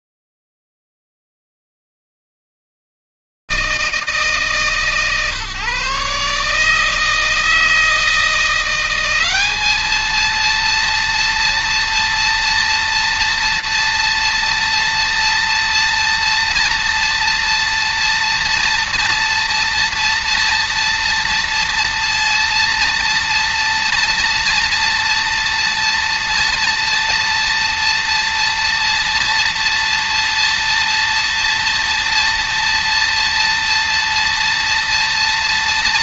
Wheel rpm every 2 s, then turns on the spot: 40, 130, 160, 150, 170, 220, 230, 230, 230, 230, 230, 230, 230, 230, 230, 230, 230, 230.
none